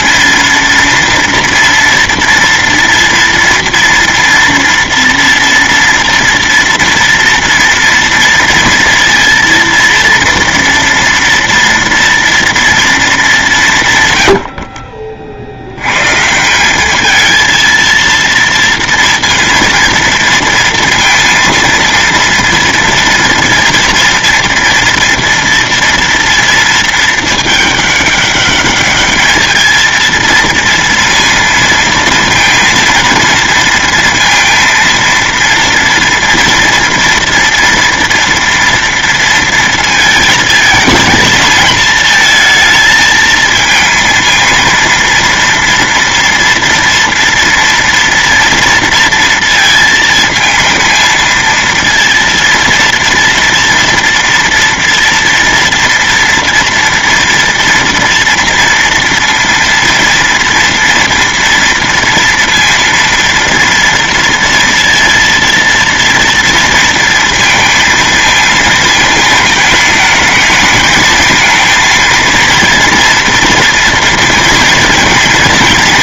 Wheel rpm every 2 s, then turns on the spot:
230, 230, 230, 230, 230, 230, 230, 70, 190, 230, 230, 230, 230, 230, 200, 230, 230, 230, 230, 230, 220, 220, 230, 230, 230, 220, 230, 230, 230, 230, 230, 230, 230, 230, 220, 220, 230, 230.
none